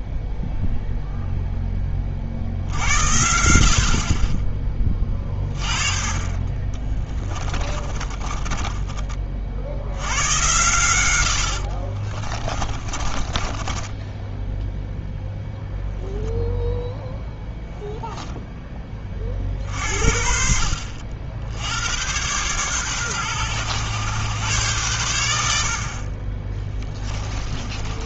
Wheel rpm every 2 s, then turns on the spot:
0, 70, 20, 40, 30, 110, 30, 0, 0, 10, 60, 120, 110, 20.
6-10 12-14